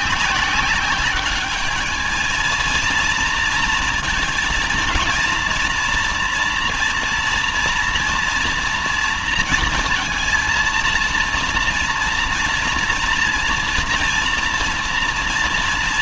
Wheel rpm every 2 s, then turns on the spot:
190, 230, 230, 240, 230, 230, 230, 230.
none